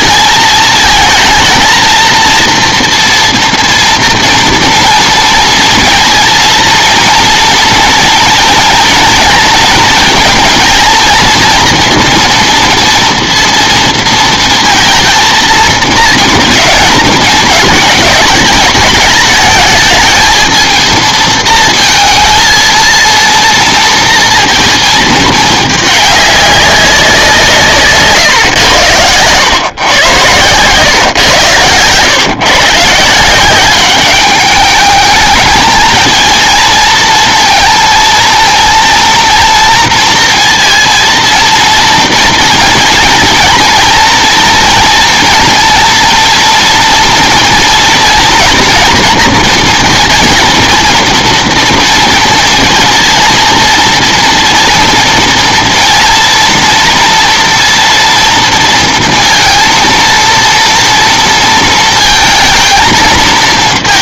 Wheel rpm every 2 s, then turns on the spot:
220, 230, 230, 230, 230, 230, 230, 230, 230, 220, 220, 230, 220, 200, 110, 140, 140, 210, 230, 230, 230, 230, 230, 230, 230, 230, 230, 230, 240, 230, 230, 230.
none